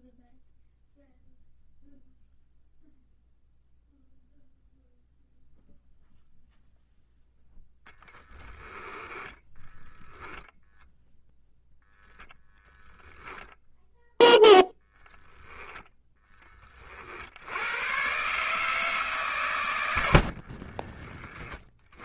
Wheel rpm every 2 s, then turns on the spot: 0, 0, 0, 0, 10, 0, 0, 0, 40, 150, 30.
8-10